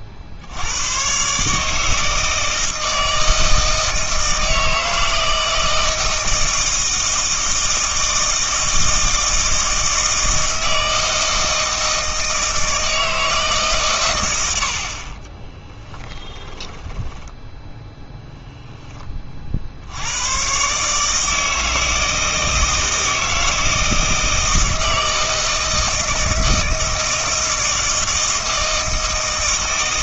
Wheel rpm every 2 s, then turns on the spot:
90, 160, 160, 160, 160, 160, 160, 80, 10, 10, 130, 160, 160, 160, 160.
16-18